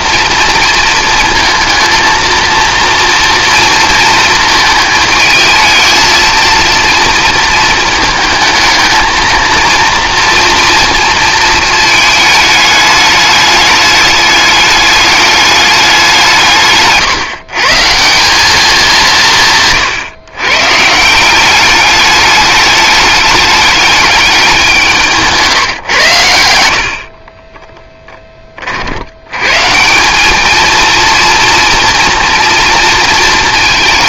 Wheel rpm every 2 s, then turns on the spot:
230, 230, 220, 230, 220, 230, 210, 210, 160, 200, 140, 210, 190, 80, 40, 220, 230.
16-18